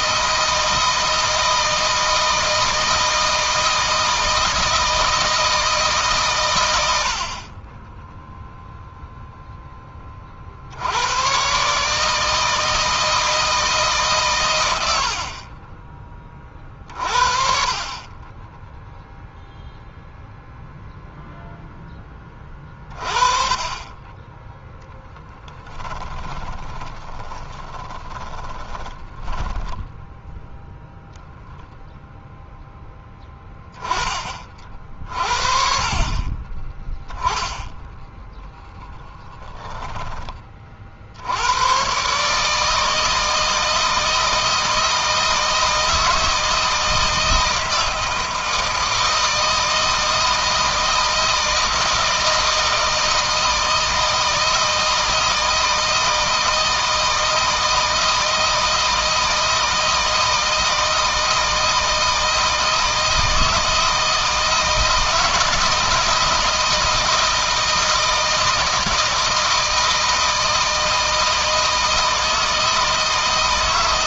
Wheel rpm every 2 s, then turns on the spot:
160, 160, 160, 90, 0, 80, 160, 80, 40, 0, 0, 30, 10, 20, 20, 10, 10, 40, 10, 10, 50, 160, 160, 160, 160, 160, 160, 160, 160, 160, 160, 160, 160, 160, 160, 160, 160.
24-32 38-40